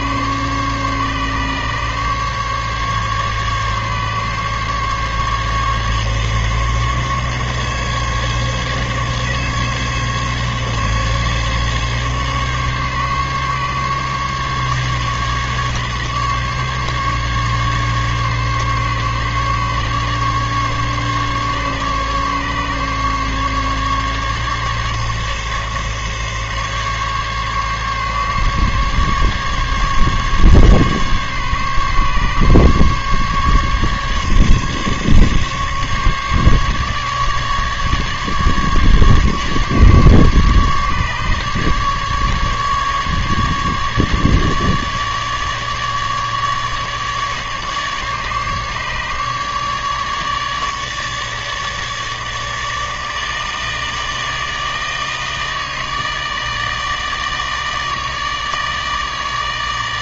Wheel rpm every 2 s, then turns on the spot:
140, 140, 140, 140, 140, 140, 140, 140, 140, 140, 140, 140, 140, 140, 140, 140, 140, 140, 150, 150, 140, 150, 150, 150, 150, 150, 150, 150, 150, 160.
none